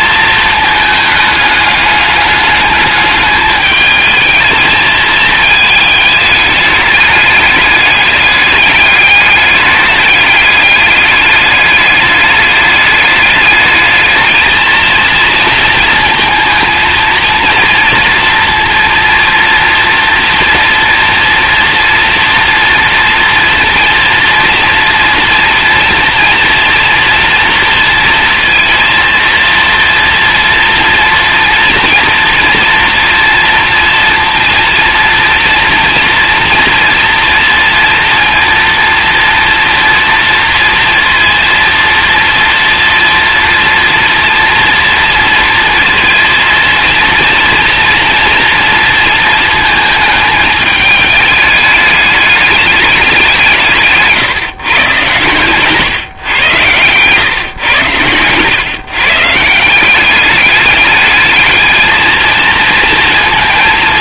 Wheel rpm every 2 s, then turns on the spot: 220, 210, 220, 210, 210, 210, 210, 230, 230, 230, 230, 230, 230, 230, 230, 230, 230, 230, 230, 230, 230, 230, 230, 230, 230, 210, 200, 130, 110, 140, 210, 230.
56-58